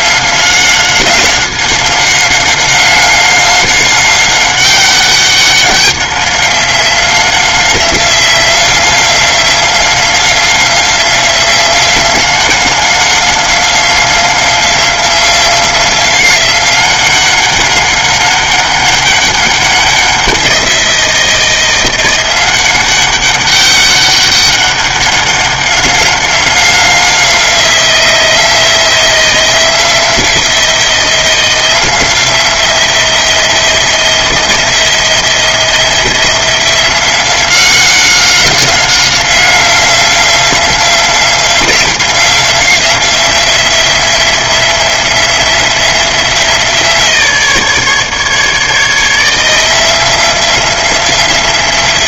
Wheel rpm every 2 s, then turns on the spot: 190, 190, 190, 190, 180, 180, 190, 180, 190, 190, 180, 180, 200, 190, 170, 170, 170, 170, 180, 190, 180, 180, 180, 170, 150, 180.
none